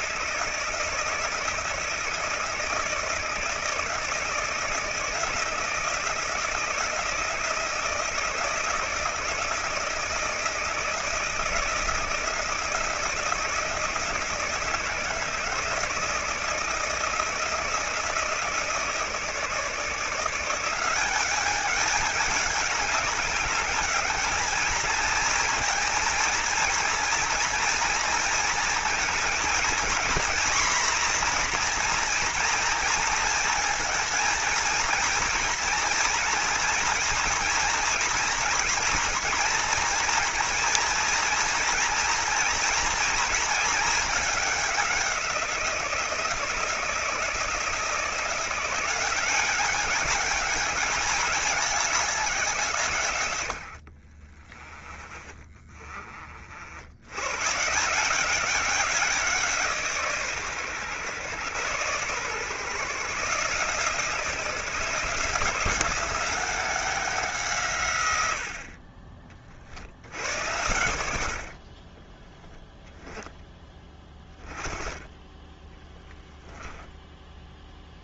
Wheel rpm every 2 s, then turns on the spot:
160, 160, 160, 170, 160, 160, 160, 160, 160, 160, 190, 200, 220, 230, 230, 240, 230, 230, 230, 230, 230, 230, 190, 160, 190, 210, 130, 20, 100, 180, 120, 140, 170, 180, 40, 70, 10, 20, 0.
54-56 70-72